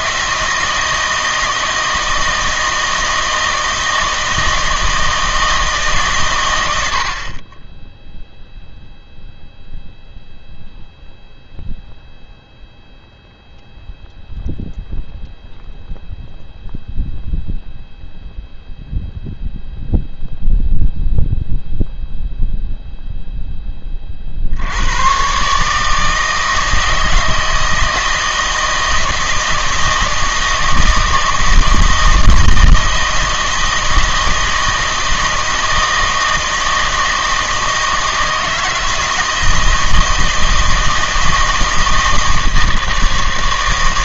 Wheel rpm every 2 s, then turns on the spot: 160, 160, 160, 80, 0, 0, 0, 0, 0, 0, 0, 0, 90, 160, 160, 160, 160, 160, 160, 160, 160, 160.
none